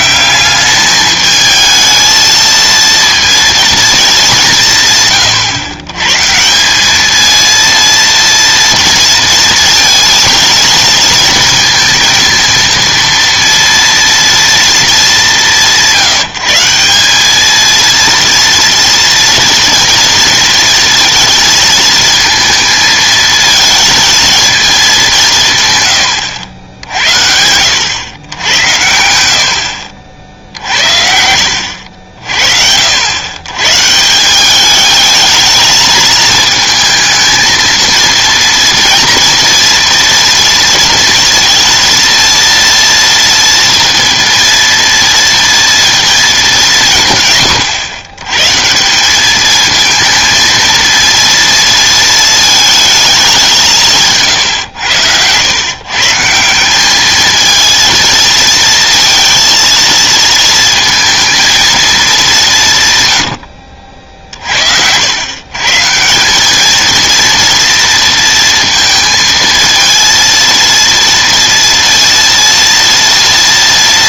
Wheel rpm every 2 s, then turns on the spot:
210, 230, 140, 200, 230, 230, 230, 210, 190, 230, 230, 220, 210, 70, 80, 60, 60, 200, 220, 230, 230, 230, 230, 190, 150, 230, 220, 110, 180, 230, 230, 160, 60, 200, 230, 230, 230.
none